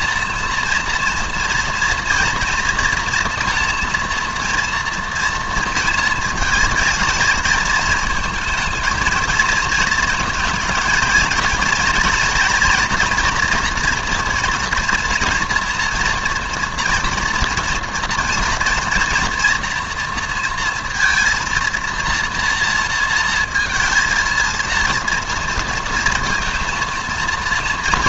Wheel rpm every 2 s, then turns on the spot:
230, 230, 230, 230, 220, 220, 230, 230, 240, 230, 230, 230, 230, 230.
none